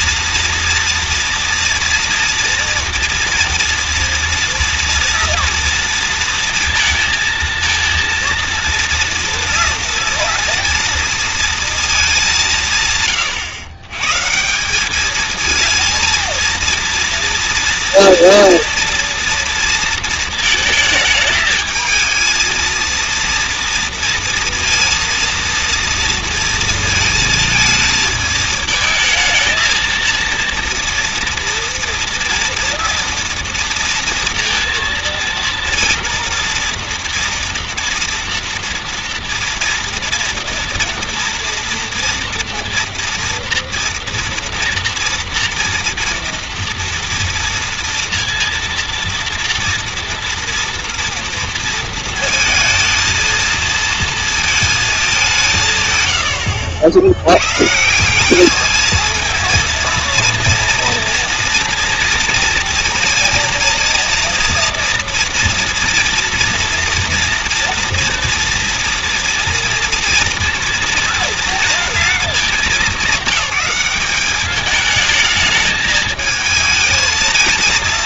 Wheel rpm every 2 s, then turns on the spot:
230, 230, 230, 230, 230, 240, 140, 200, 230, 230, 220, 230, 230, 230, 220, 230, 240, 230, 230, 230, 230, 240, 230, 230, 230, 230, 220, 220, 80, 220, 230, 230, 230, 230, 230, 230, 200, 210, 220.
none